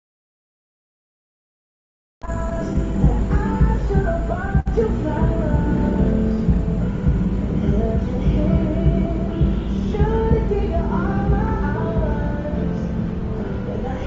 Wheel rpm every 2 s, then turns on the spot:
0, 0, 0, 0, 0, 0, 0.
none